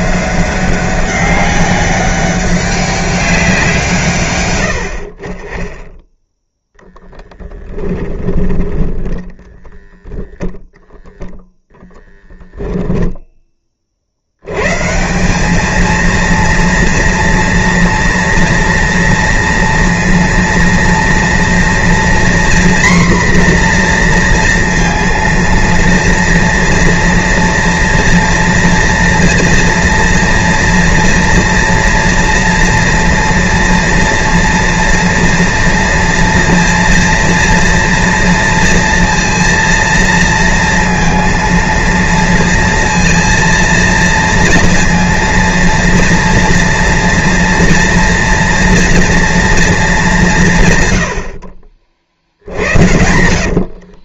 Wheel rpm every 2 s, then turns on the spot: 190, 200, 100, 0, 10, 20, 0, 140, 230, 230, 230, 240, 230, 230, 240, 230, 230, 230, 230, 230, 230, 230, 230, 230, 230, 140, 80.
8-12